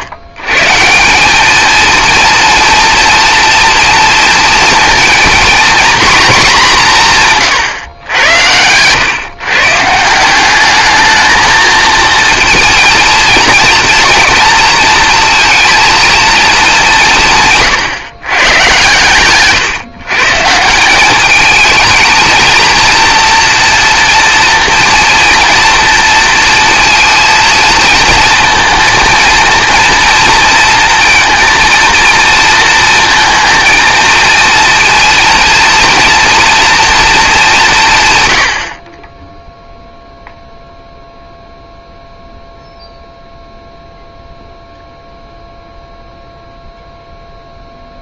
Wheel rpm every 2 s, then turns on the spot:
180, 230, 230, 180, 120, 210, 230, 230, 180, 120, 200, 230, 230, 230, 230, 230, 220, 230, 220, 10, 0, 0, 0, 0.
none